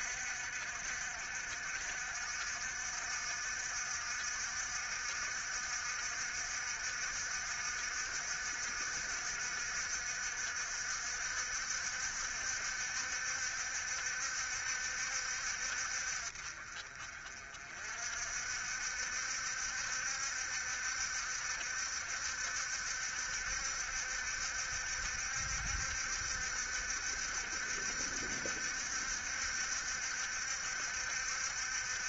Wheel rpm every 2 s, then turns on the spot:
60, 60, 60, 60, 60, 60, 60, 70, 40, 60, 70, 70, 70, 70, 70, 70.
none